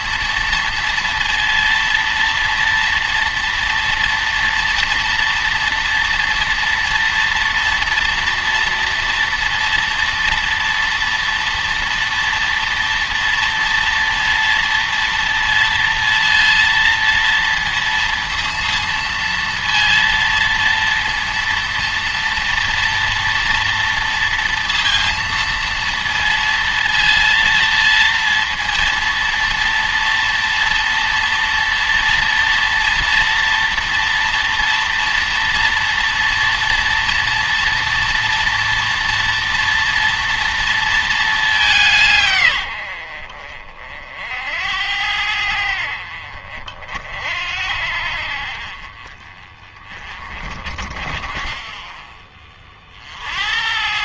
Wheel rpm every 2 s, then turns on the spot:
230, 230, 230, 230, 230, 230, 230, 230, 230, 230, 230, 230, 230, 230, 230, 230, 230, 230, 230, 240, 230, 100, 70, 50, 50, 40, 40.
none